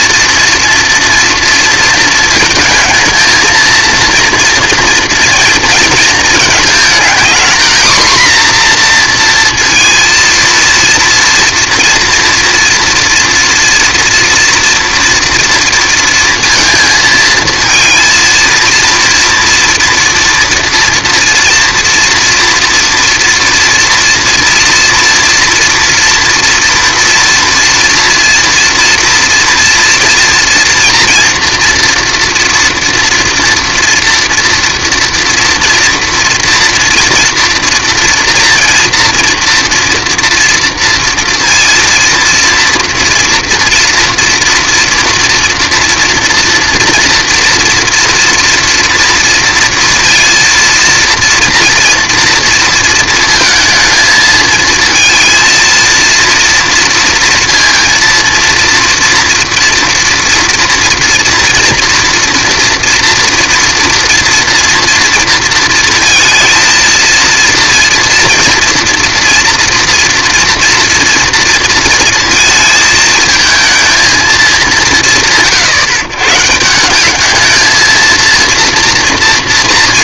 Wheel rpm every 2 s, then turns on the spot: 230, 220, 240, 220, 250, 230, 230, 230, 230, 230, 230, 230, 240, 230, 230, 230, 240, 240, 230, 230, 240, 230, 230, 230, 230, 230, 230, 220, 230, 230, 230, 230, 230, 230, 230, 230, 230, 210, 150, 230.
none